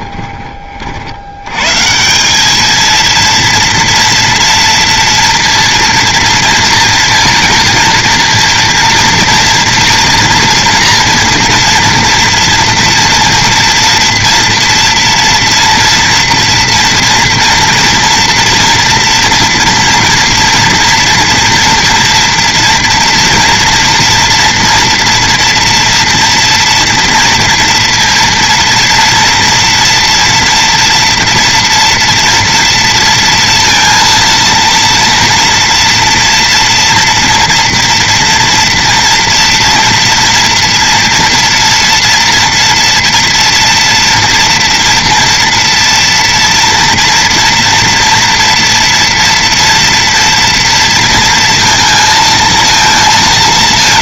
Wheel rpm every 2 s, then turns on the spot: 40, 220, 230, 230, 230, 240, 240, 230, 240, 230, 230, 230, 230, 230, 230, 230, 230, 230, 230, 240, 230, 230, 230, 230, 230, 230, 230.
none